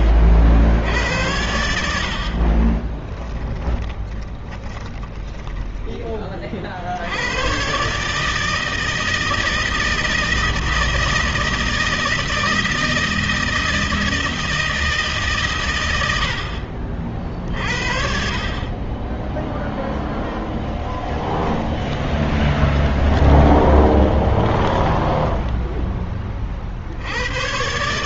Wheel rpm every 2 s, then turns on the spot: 80, 20, 20, 70, 160, 160, 160, 150, 50, 10, 20, 20, 10, 70.
2-6 20-26